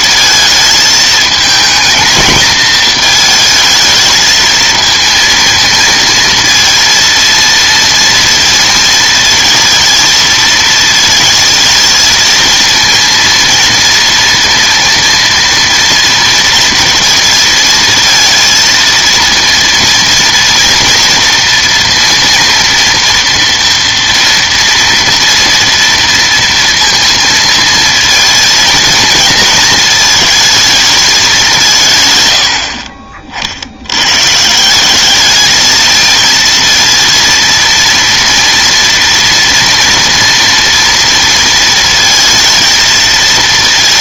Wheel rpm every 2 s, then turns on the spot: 220, 220, 220, 230, 230, 230, 230, 230, 230, 230, 230, 230, 230, 230, 230, 220, 70, 180, 230, 240, 230, 230.
none